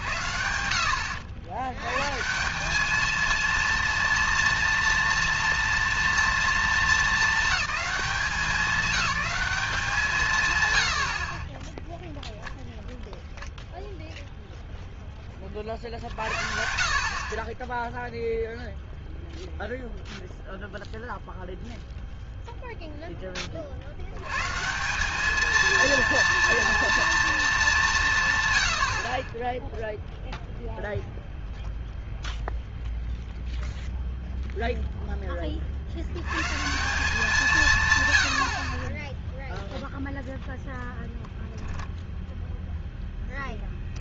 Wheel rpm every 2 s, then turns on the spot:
80, 200, 230, 220, 210, 120, 0, 0, 60, 0, 0, 0, 150, 230, 100, 0, 0, 0, 160, 40, 0, 0.
none